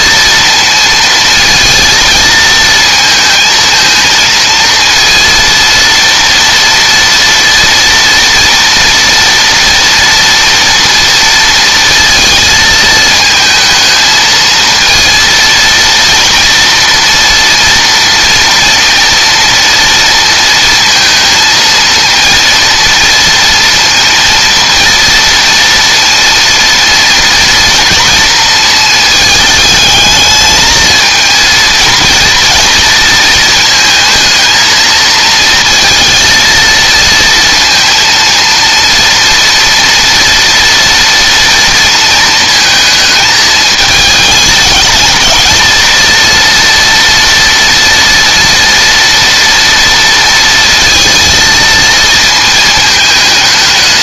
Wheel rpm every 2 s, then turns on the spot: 230, 220, 230, 230, 230, 230, 220, 230, 230, 230, 230, 230, 230, 230, 220, 220, 220, 220, 230, 230, 230, 220, 220, 230, 230, 230, 220.
none